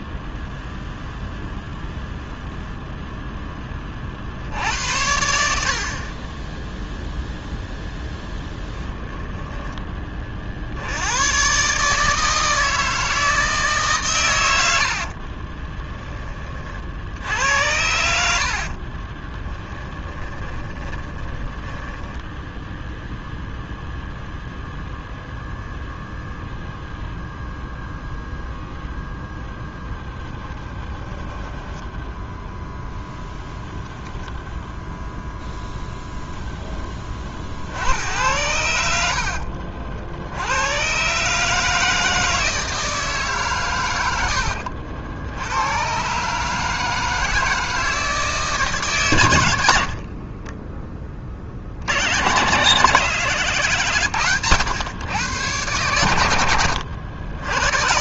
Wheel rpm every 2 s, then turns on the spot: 0, 0, 80, 0, 10, 80, 160, 70, 60, 30, 20, 0, 0, 0, 0, 10, 0, 0, 30, 70, 130, 160, 80, 160, 130, 30, 130, 120, 70.
14-16 18-22 30-32